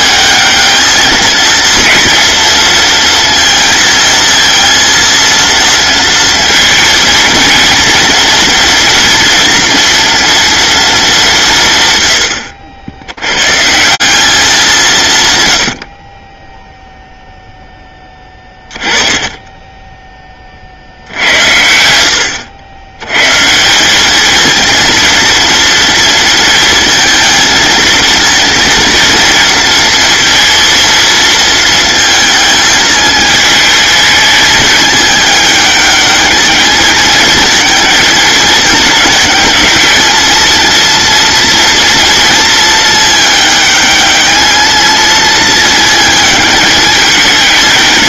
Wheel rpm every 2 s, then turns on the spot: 220, 230, 230, 230, 240, 220, 90, 170, 0, 20, 50, 90, 220, 230, 230, 230, 220, 210, 220, 220, 230, 220, 220, 210.
none